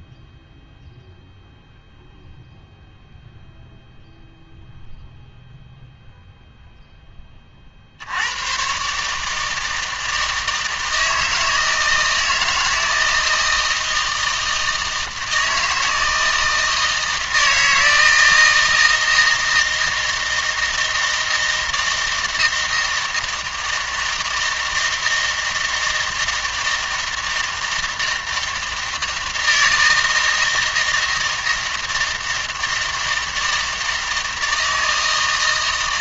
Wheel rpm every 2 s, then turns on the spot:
0, 0, 0, 0, 130, 160, 160, 160, 160, 160, 160, 160, 160, 160, 160, 160, 160, 160.
none